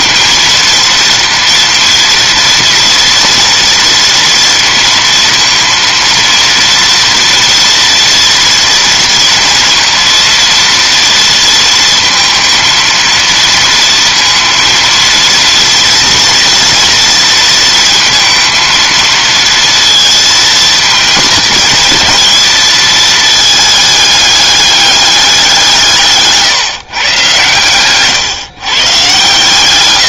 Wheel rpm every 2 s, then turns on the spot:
230, 230, 230, 230, 230, 230, 230, 230, 230, 220, 220, 220, 200, 140, 140.
none